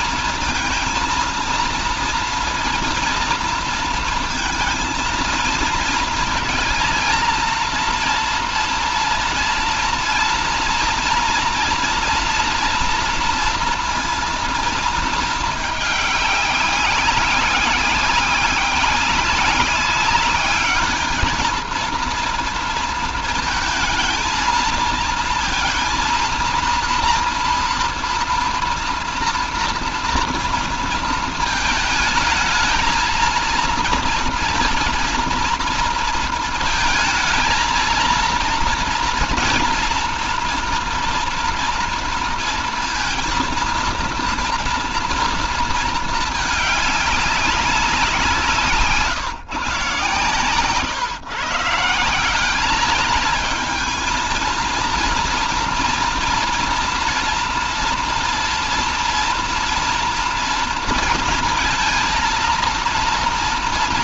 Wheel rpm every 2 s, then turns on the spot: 230, 230, 230, 230, 230, 230, 230, 230, 200, 190, 210, 230, 230, 230, 230, 230, 220, 230, 220, 230, 240, 230, 240, 210, 150, 140, 200, 230, 240, 230, 230, 230.
none